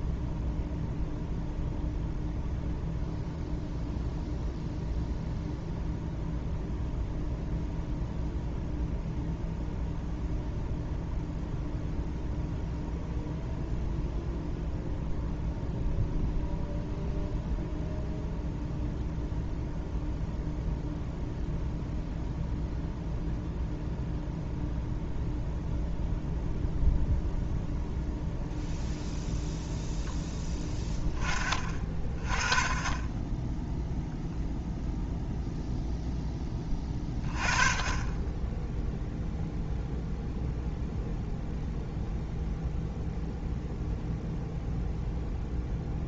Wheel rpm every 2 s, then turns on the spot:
0, 0, 0, 0, 0, 0, 0, 0, 0, 0, 0, 0, 0, 0, 0, 10, 20, 0, 20, 0, 0, 0, 0.
none